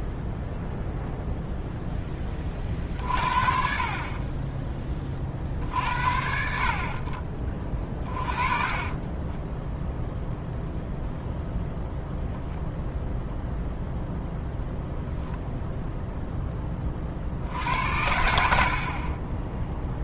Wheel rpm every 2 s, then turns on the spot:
0, 30, 20, 50, 20, 0, 0, 0, 10, 60.
8-10